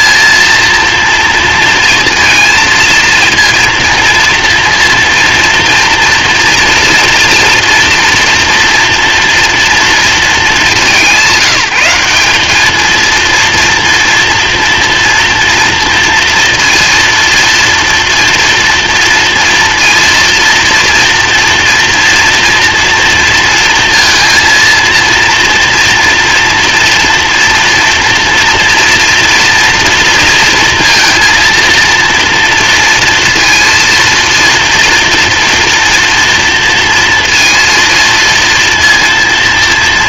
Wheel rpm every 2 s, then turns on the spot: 230, 220, 230, 230, 230, 190, 210, 230, 230, 240, 230, 230, 230, 230, 240, 230, 230, 230, 230, 230.
none